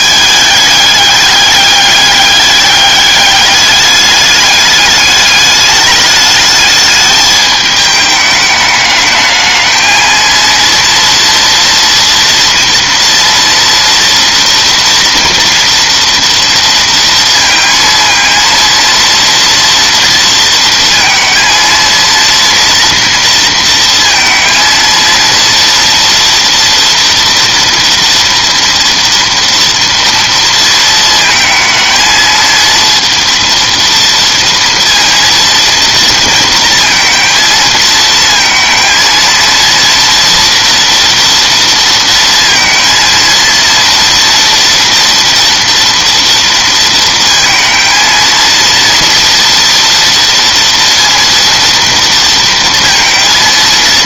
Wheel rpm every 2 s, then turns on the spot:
200, 200, 210, 210, 220, 230, 240, 230, 230, 230, 230, 230, 230, 230, 230, 220, 230, 230, 230, 230, 230, 230, 240, 230, 230, 230, 230.
none